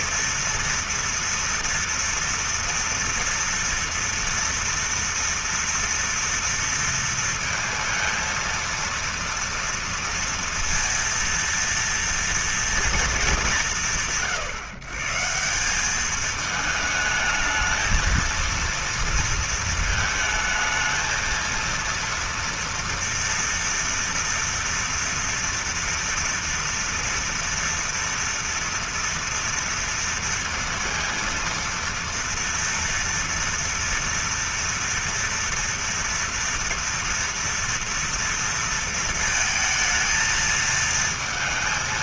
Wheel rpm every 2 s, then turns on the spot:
230, 230, 230, 230, 230, 230, 230, 150, 210, 230, 220, 230, 230, 230, 230, 230, 230, 230, 230, 230, 220.
none